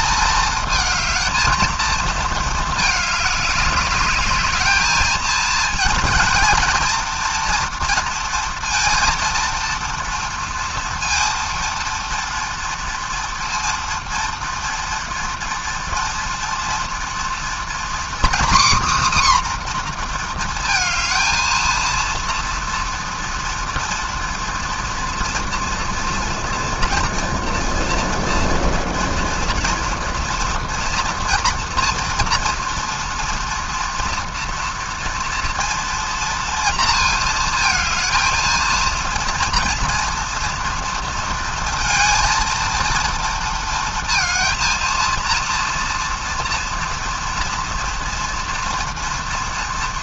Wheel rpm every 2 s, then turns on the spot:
220, 220, 210, 230, 230, 230, 230, 230, 230, 260, 230, 230, 230, 240, 240, 230, 230, 230, 230, 230, 230, 230, 230, 230, 240.
none